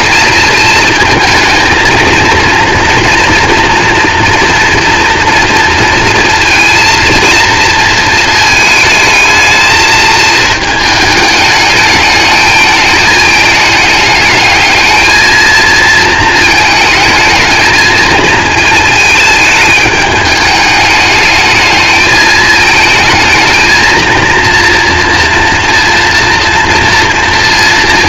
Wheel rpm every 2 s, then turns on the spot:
220, 240, 240, 230, 220, 220, 210, 210, 220, 220, 210, 220, 230, 230.
none